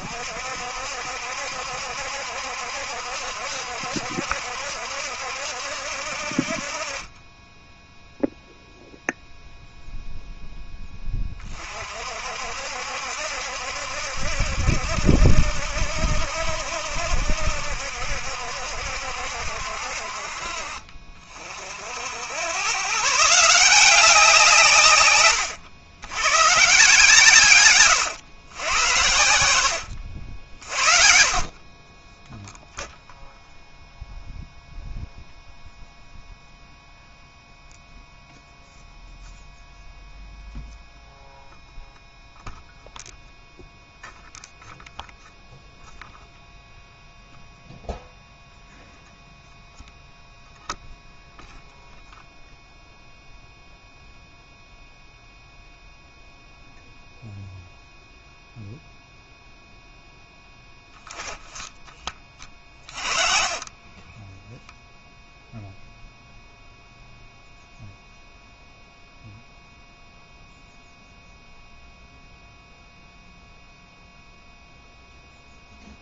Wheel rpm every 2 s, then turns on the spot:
60, 70, 70, 40, 0, 10, 60, 70, 70, 70, 40, 120, 160, 130, 100, 40, 0, 0, 0, 0, 0, 0, 0, 0, 0, 0, 0, 0, 0, 0, 10, 30, 0, 0, 0, 0, 0, 0.
none